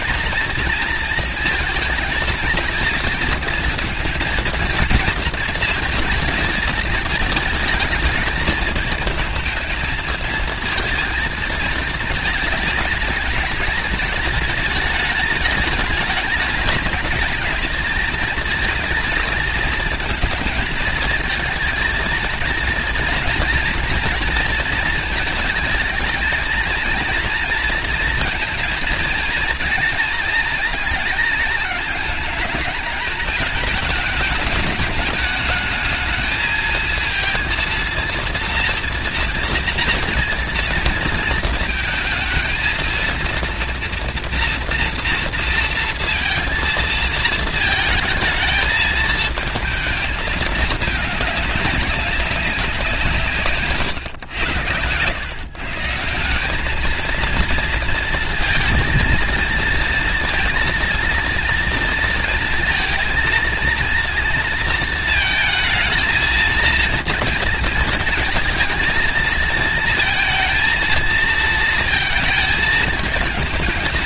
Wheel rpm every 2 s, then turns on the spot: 230, 230, 230, 220, 220, 230, 220, 210, 210, 230, 220, 230, 230, 230, 230, 220, 210, 210, 220, 230, 230, 220, 230, 230, 220, 220, 200, 110, 210, 230, 230, 230, 230, 230, 230, 230, 220.
none